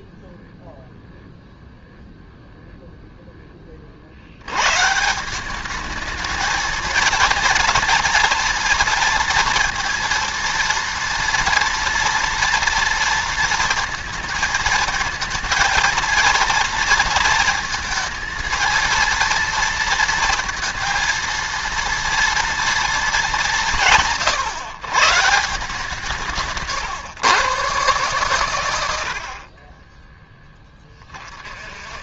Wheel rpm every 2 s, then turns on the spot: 0, 0, 110, 230, 230, 230, 230, 220, 230, 230, 230, 230, 140, 160, 100, 20.
none